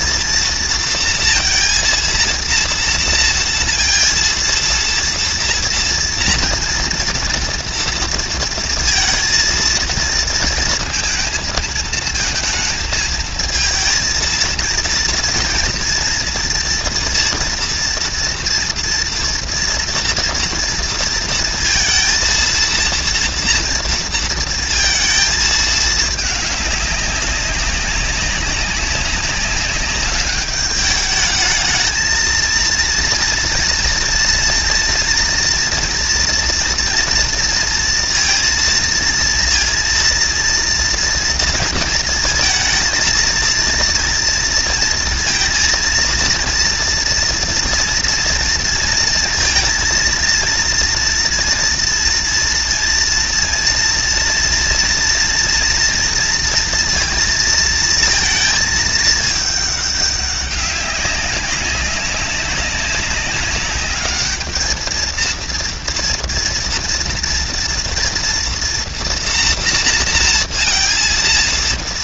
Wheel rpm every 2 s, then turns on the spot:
230, 230, 230, 230, 230, 230, 230, 230, 230, 230, 230, 230, 230, 220, 200, 200, 220, 230, 230, 230, 230, 230, 230, 230, 230, 230, 230, 230, 230, 230, 210, 200, 200, 230, 230, 230.
none